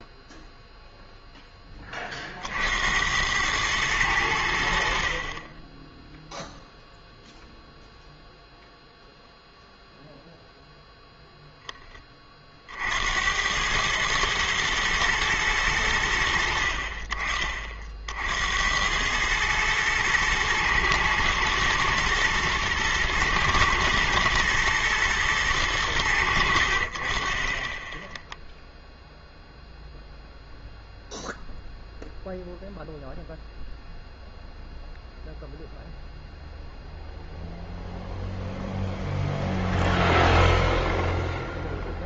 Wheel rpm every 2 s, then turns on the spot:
0, 70, 70, 0, 0, 0, 50, 110, 50, 80, 110, 110, 120, 60, 0, 0, 0, 0, 0, 0, 0.
none